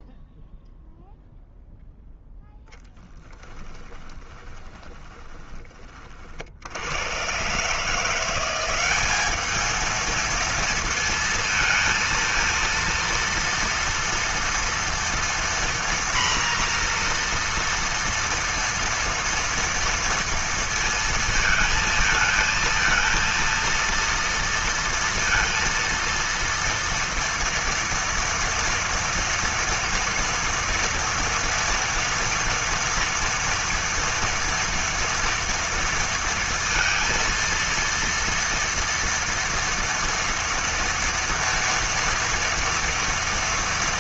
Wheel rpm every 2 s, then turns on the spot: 0, 0, 20, 80, 180, 230, 230, 230, 240, 230, 230, 220, 230, 230, 230, 240, 240, 230, 230, 230, 230, 230.
4-6